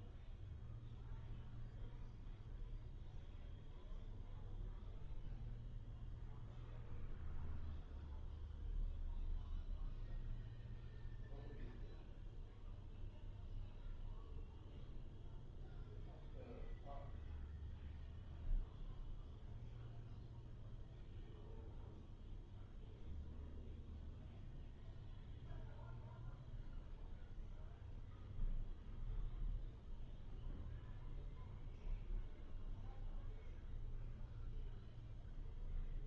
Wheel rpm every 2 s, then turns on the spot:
0, 0, 0, 0, 0, 0, 0, 0, 0, 0, 0, 0, 0, 0, 0, 0, 0, 0.
none